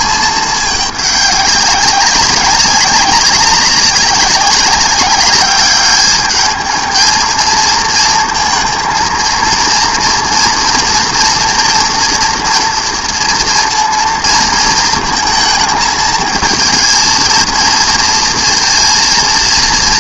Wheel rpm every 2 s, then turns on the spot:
210, 200, 200, 220, 230, 240, 230, 230, 220, 230.
none